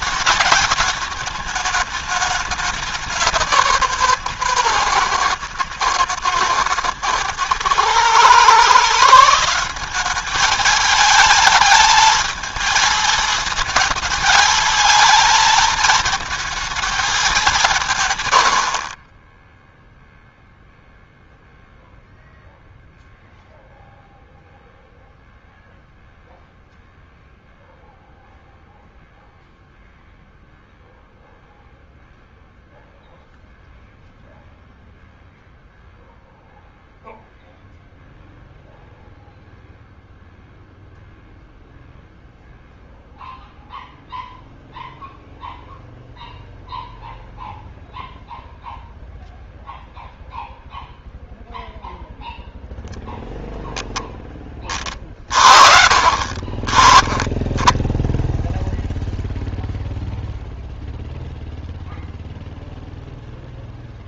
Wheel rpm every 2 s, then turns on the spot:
210, 200, 130, 110, 150, 210, 220, 220, 220, 40, 0, 0, 0, 0, 0, 0, 0, 0, 0, 0, 0, 0, 0, 0, 0, 0, 0, 30, 40, 0, 0, 0.
none